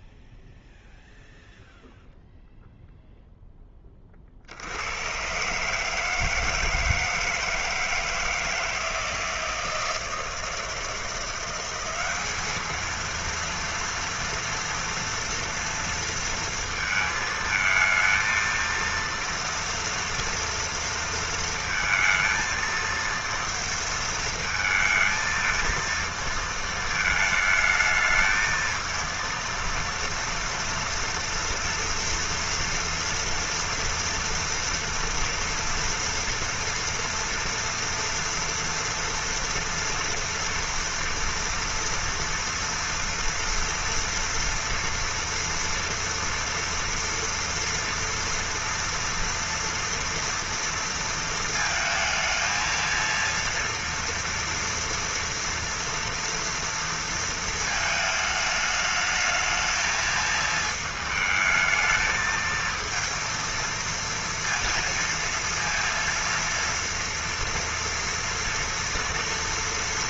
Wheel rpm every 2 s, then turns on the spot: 0, 0, 70, 160, 160, 160, 210, 230, 230, 230, 230, 230, 220, 230, 220, 230, 230, 230, 230, 230, 230, 240, 230, 230, 230, 230, 220, 230, 230, 210, 220, 220, 230, 230, 230.
none